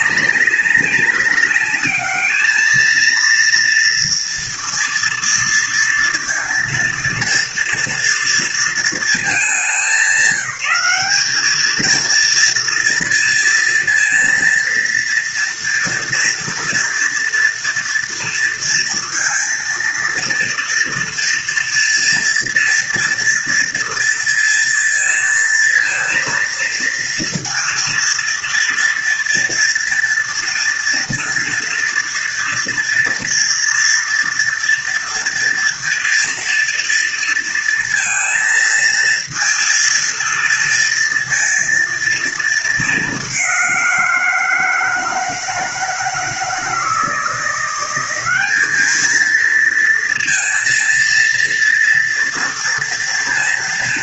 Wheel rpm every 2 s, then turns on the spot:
190, 220, 230, 230, 210, 190, 230, 230, 230, 230, 230, 240, 230, 230, 230, 230, 230, 230, 230, 230, 230, 210, 160, 170, 220, 230, 230.
none